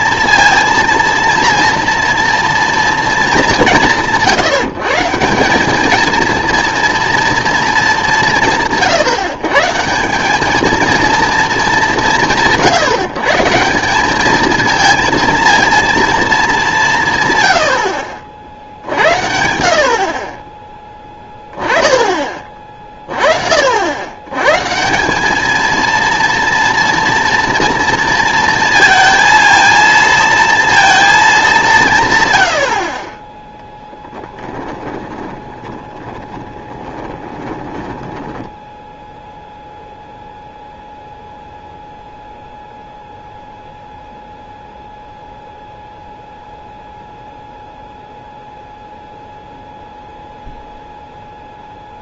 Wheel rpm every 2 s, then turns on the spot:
230, 230, 160, 230, 160, 210, 160, 220, 200, 60, 20, 30, 150, 230, 230, 230, 100, 10, 20, 10, 0, 0, 0, 0, 0, 0.
34-38